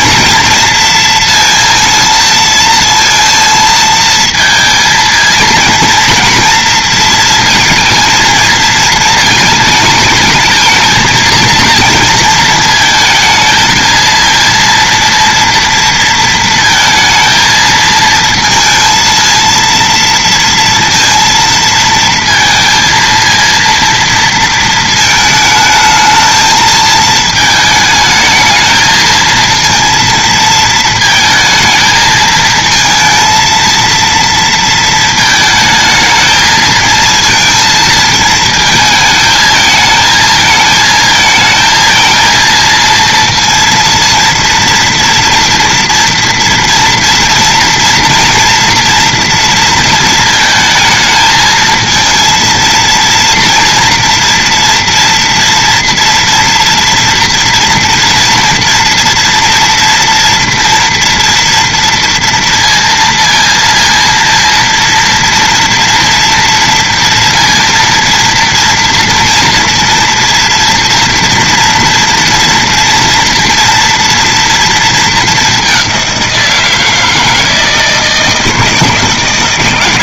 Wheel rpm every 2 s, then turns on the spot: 230, 230, 230, 230, 230, 220, 230, 230, 230, 220, 230, 230, 220, 220, 220, 230, 230, 220, 220, 220, 220, 230, 230, 230, 230, 220, 230, 230, 230, 230, 230, 230, 230, 230, 230, 240, 230, 230, 160, 160.
none